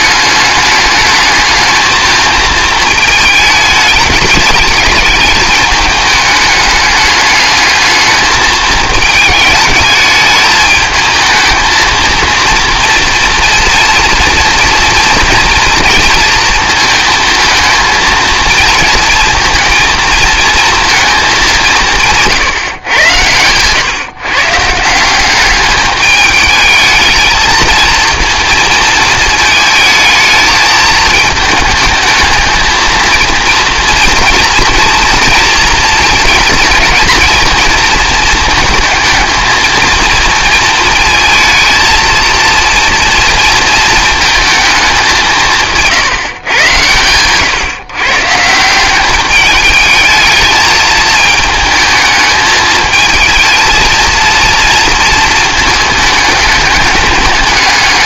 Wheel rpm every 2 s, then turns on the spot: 210, 220, 210, 210, 210, 220, 230, 230, 220, 230, 220, 130, 150, 220, 230, 220, 220, 230, 220, 220, 220, 230, 210, 120, 180, 220, 220, 230, 210.
none